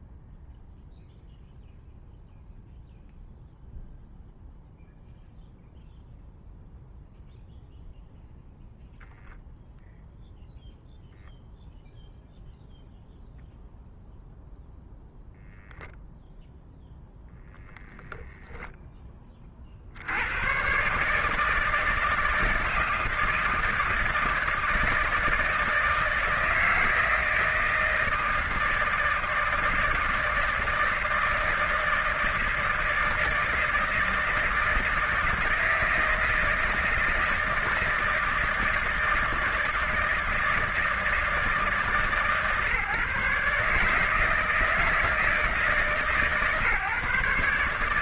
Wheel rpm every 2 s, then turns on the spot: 0, 0, 0, 0, 0, 0, 0, 0, 20, 80, 160, 160, 160, 160, 160, 160, 160, 160, 160, 160, 160, 150, 150, 140.
16-18